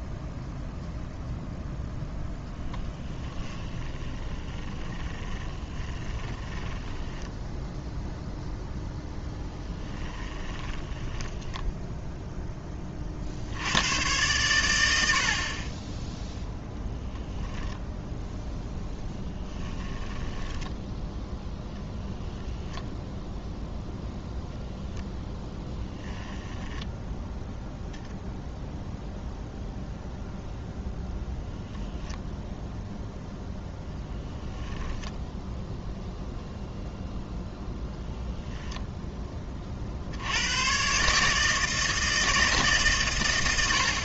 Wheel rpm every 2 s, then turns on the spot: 0, 10, 20, 10, 10, 20, 20, 90, 0, 0, 10, 20, 0, 10, 0, 0, 0, 10, 0, 0, 120, 140.
2-8 10-12 22-24